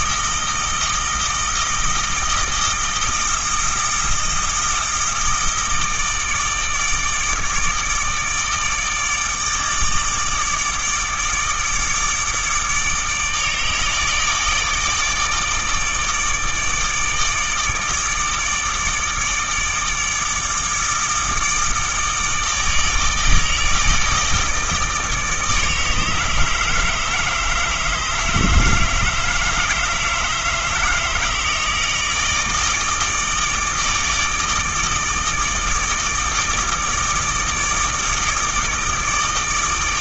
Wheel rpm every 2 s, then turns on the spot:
160, 160, 160, 160, 150, 160, 150, 160, 160, 160, 160, 160, 160, 160, 160, 160, 160, 160, 160, 160.
none